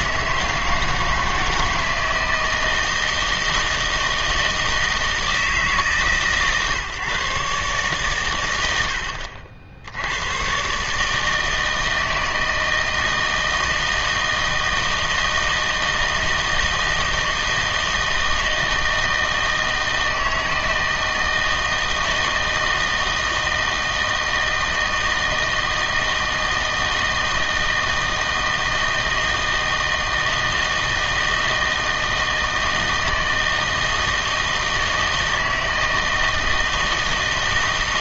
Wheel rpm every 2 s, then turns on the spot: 160, 160, 160, 140, 100, 120, 160, 160, 160, 160, 160, 160, 160, 160, 160, 160, 160, 160, 160.
none